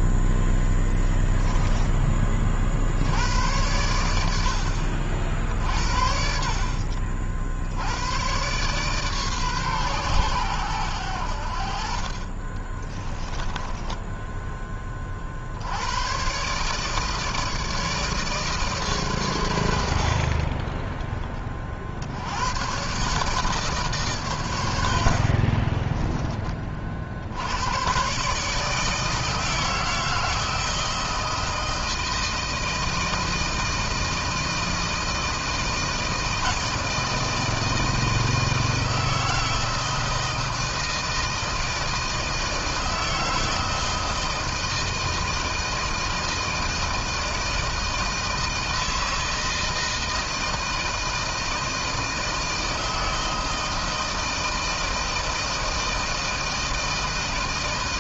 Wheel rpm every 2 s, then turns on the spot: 10, 60, 60, 70, 130, 100, 30, 20, 140, 140, 30, 120, 90, 40, 150, 160, 160, 160, 160, 160, 160, 160, 160, 160, 160, 160, 160, 160, 160.
6-8 12-14 24-26